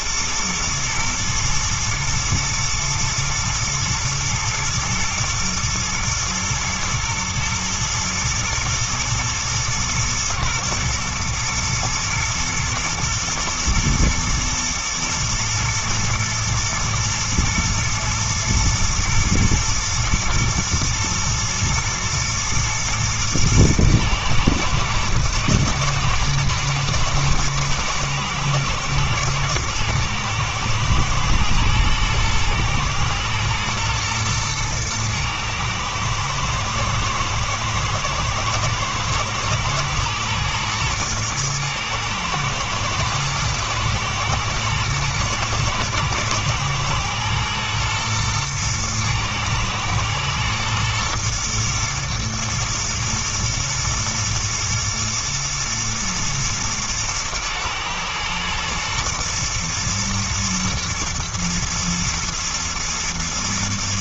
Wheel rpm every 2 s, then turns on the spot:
120, 120, 110, 110, 120, 110, 110, 120, 120, 110, 110, 120, 110, 110, 110, 120, 120, 120, 110, 120, 110, 120, 110, 110, 110, 110, 110, 120, 110, 110, 110, 110.
none